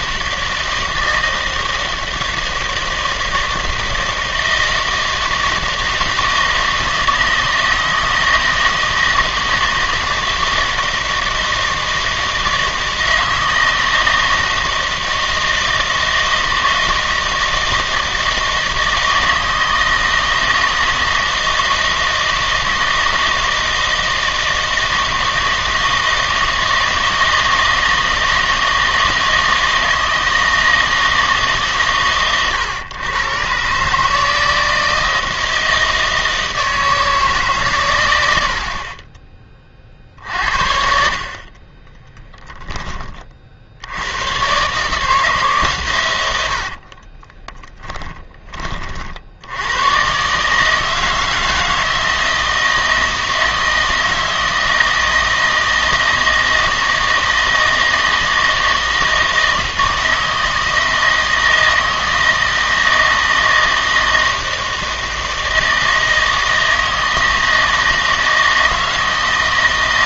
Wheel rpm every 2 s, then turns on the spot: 160, 160, 160, 160, 160, 160, 160, 160, 160, 160, 160, 160, 160, 160, 160, 160, 120, 160, 160, 60, 60, 20, 140, 70, 30, 150, 160, 160, 160, 160, 160, 160, 160, 160, 160.
38-40 46-48